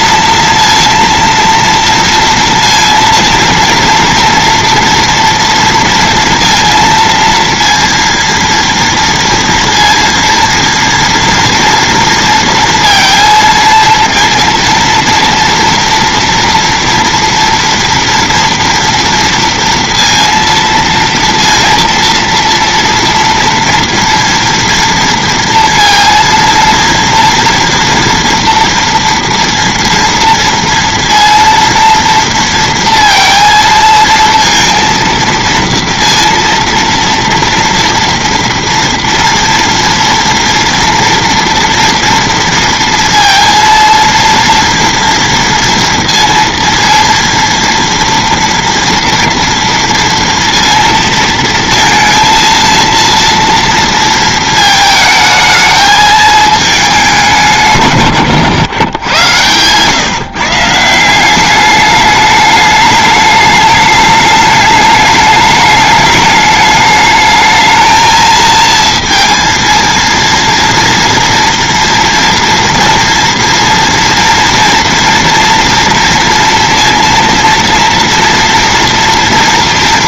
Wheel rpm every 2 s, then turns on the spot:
230, 230, 230, 230, 230, 230, 230, 230, 230, 230, 230, 230, 230, 230, 230, 230, 230, 230, 230, 230, 230, 230, 230, 230, 230, 230, 230, 220, 200, 110, 170, 210, 210, 210, 230, 230, 240, 230, 230, 230.
none